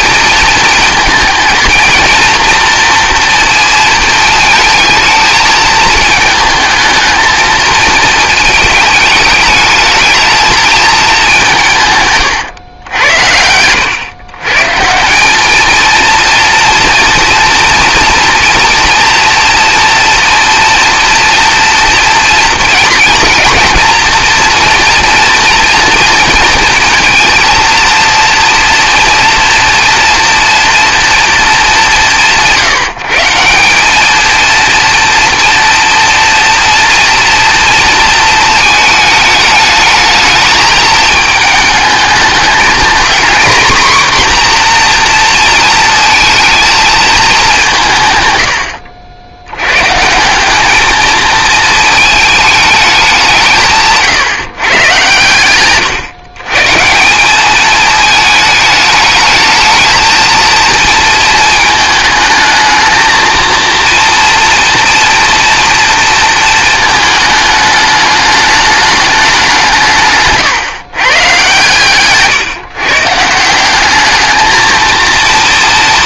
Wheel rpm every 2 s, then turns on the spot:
230, 230, 220, 220, 220, 210, 90, 170, 230, 230, 230, 230, 230, 230, 230, 230, 160, 230, 230, 220, 220, 230, 240, 220, 70, 210, 210, 120, 150, 210, 230, 220, 230, 220, 210, 130, 140, 220.
none